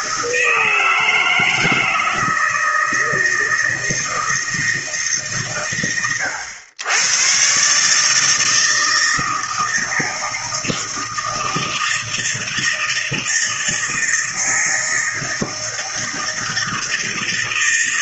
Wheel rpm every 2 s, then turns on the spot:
160, 160, 160, 100, 160, 160, 160, 160, 160.
none